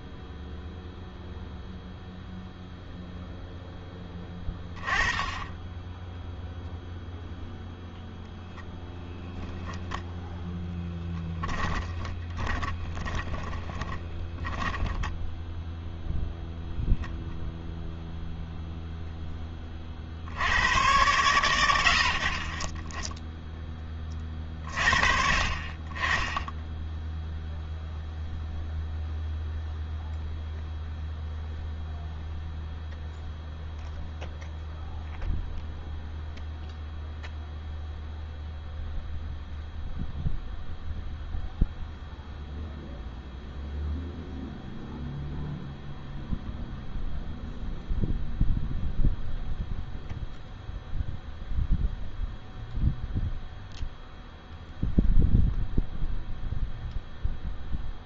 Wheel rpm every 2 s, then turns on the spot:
0, 0, 10, 0, 0, 10, 20, 10, 0, 0, 110, 30, 40, 0, 0, 0, 0, 0, 0, 0, 0, 0, 0, 0, 0, 0, 0, 0, 0.
10-16